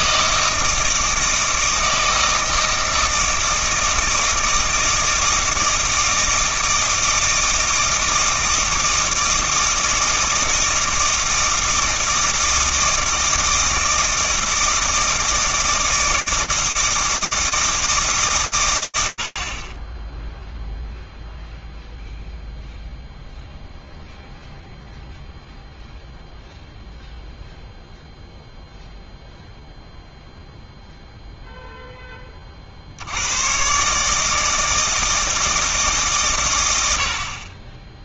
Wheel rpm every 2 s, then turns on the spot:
160, 160, 160, 160, 160, 160, 160, 160, 160, 110, 0, 0, 0, 0, 0, 10, 140, 150, 10.
none